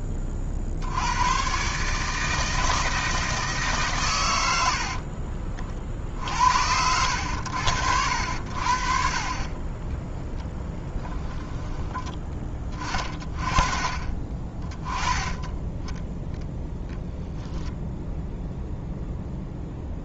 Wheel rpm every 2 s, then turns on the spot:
40, 160, 70, 70, 60, 10, 30, 20, 0, 0.
10-12